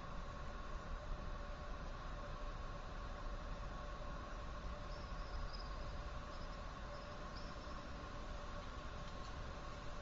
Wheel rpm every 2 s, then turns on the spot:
0, 0, 0, 0, 0.
none